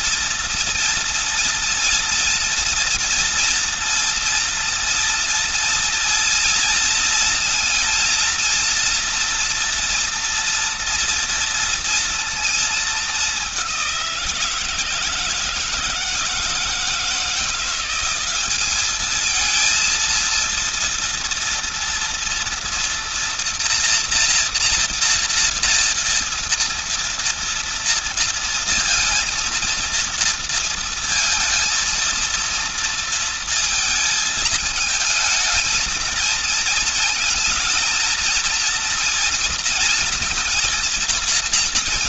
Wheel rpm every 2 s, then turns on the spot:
230, 230, 230, 230, 230, 230, 220, 170, 160, 200, 230, 230, 240, 230, 230, 230, 230, 220, 230, 230, 230.
none